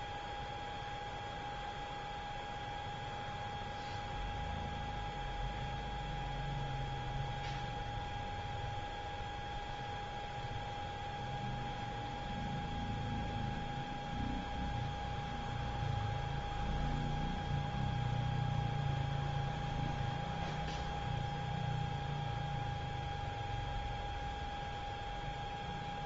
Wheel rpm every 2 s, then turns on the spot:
0, 0, 0, 0, 0, 0, 0, 0, 0, 0, 0, 0, 0.
none